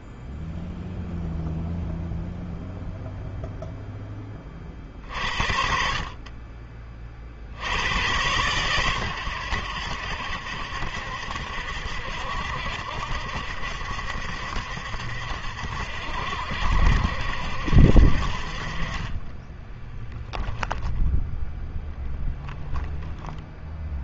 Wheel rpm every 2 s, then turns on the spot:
0, 0, 40, 40, 110, 70, 70, 70, 70, 30, 0, 10.
18-20